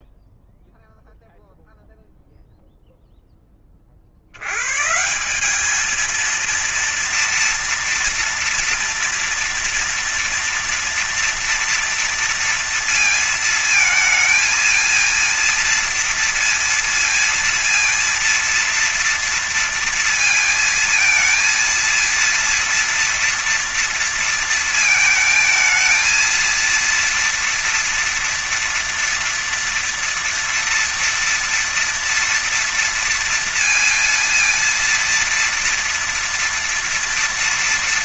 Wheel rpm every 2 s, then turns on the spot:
0, 0, 80, 230, 230, 230, 230, 220, 230, 230, 230, 230, 230, 230, 230, 230, 230, 230, 230.
none